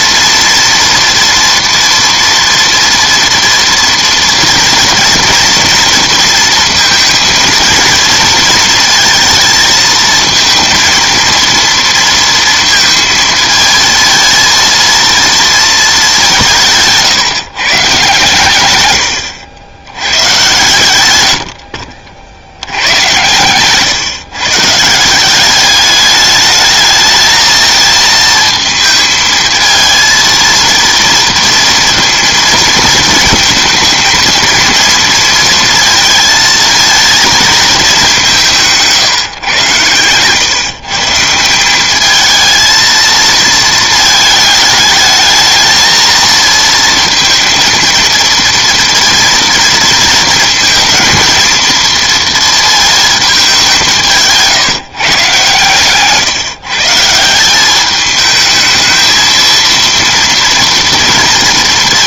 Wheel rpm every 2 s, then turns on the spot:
230, 230, 230, 230, 230, 230, 230, 230, 150, 130, 120, 100, 150, 210, 220, 230, 230, 230, 230, 160, 140, 220, 220, 230, 230, 230, 230, 160, 150, 220, 230.
16-18